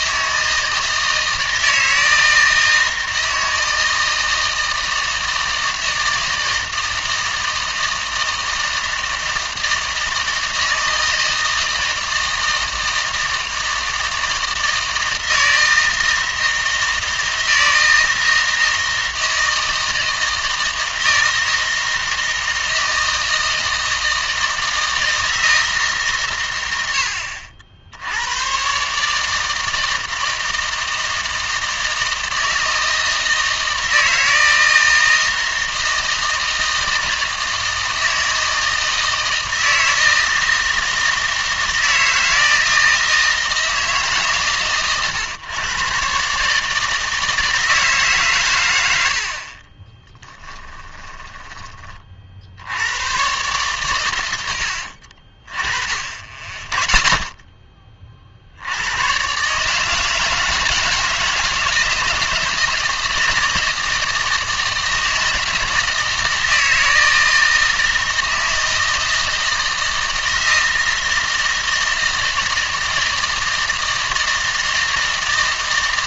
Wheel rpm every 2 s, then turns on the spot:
160, 160, 160, 160, 160, 160, 160, 160, 160, 160, 160, 160, 160, 100, 140, 160, 160, 160, 160, 160, 160, 160, 140, 150, 100, 20, 90, 60, 20, 90, 160, 160, 160, 160, 160, 160, 160, 160.
50-52